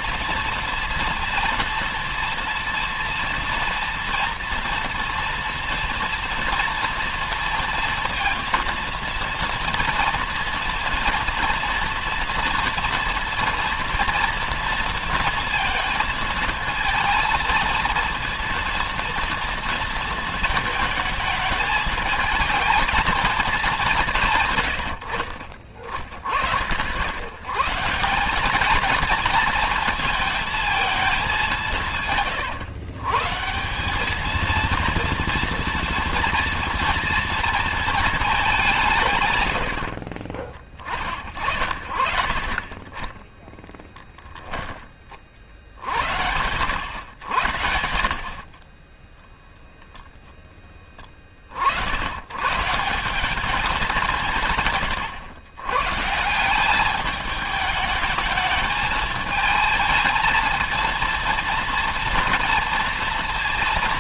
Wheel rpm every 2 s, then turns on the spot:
230, 240, 230, 230, 230, 230, 230, 230, 220, 230, 220, 220, 110, 60, 200, 220, 110, 230, 230, 190, 30, 40, 10, 90, 20, 10, 150, 150, 190, 220, 230, 230.
none